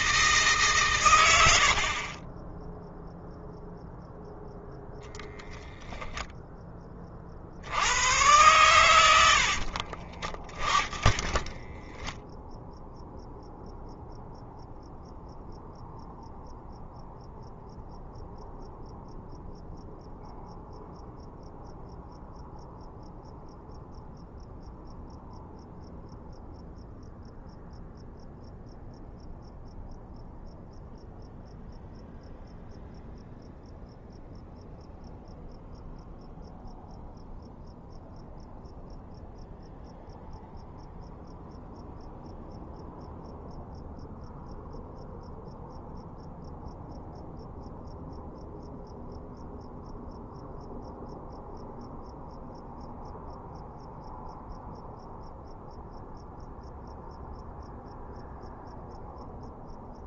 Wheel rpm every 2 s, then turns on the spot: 130, 0, 0, 20, 100, 20, 0, 0, 0, 0, 0, 0, 0, 0, 0, 0, 0, 0, 0, 0, 0, 0, 0, 0, 0, 0, 0, 0, 0, 0.
10-12